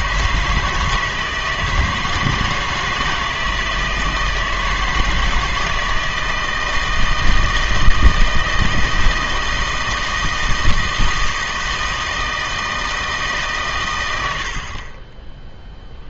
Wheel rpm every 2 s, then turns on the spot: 160, 160, 160, 160, 160, 160, 160, 40.
none